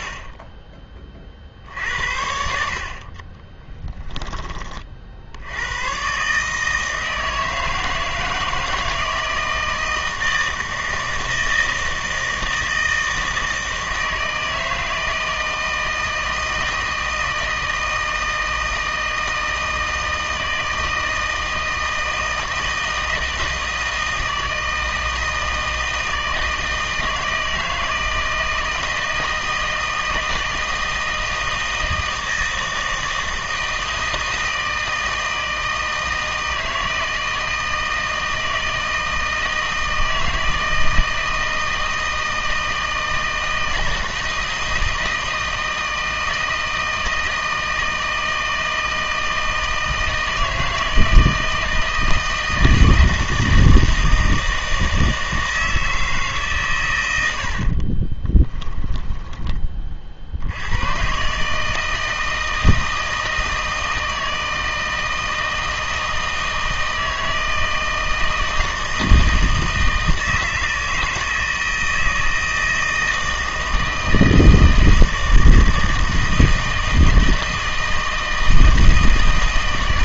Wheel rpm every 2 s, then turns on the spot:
30, 60, 40, 160, 160, 160, 160, 160, 160, 160, 160, 160, 160, 160, 160, 160, 160, 160, 160, 160, 160, 160, 160, 160, 160, 160, 160, 160, 130, 20, 100, 160, 160, 160, 160, 160, 160, 160, 160, 160.
58-60